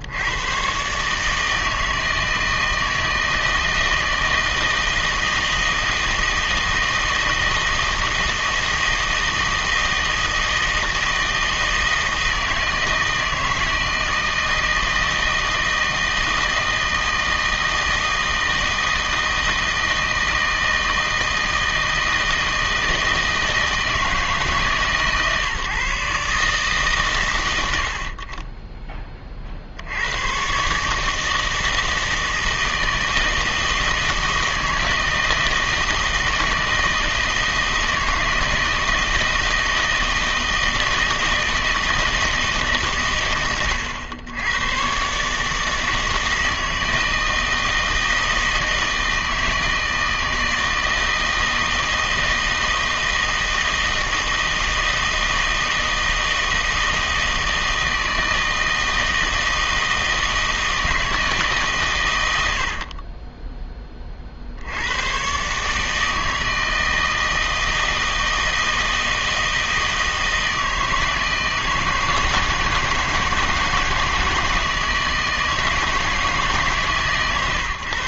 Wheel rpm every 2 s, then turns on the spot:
120, 160, 160, 160, 160, 160, 160, 160, 160, 160, 160, 160, 150, 130, 20, 130, 160, 160, 160, 160, 160, 140, 110, 160, 160, 160, 160, 160, 160, 160, 160, 70, 80, 160, 160, 160, 160, 160, 140.
62-64